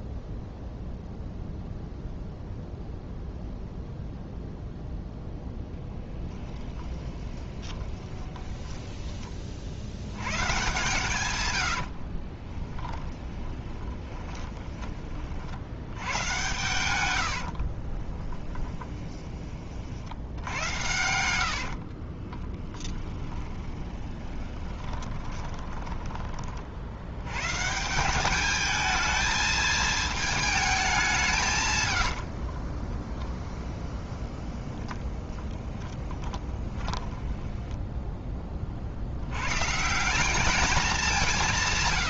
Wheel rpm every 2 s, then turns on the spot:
0, 0, 0, 20, 10, 130, 20, 30, 110, 20, 80, 20, 20, 80, 220, 200, 20, 20, 20, 60, 190.
6-10 12-14 16-26 32-38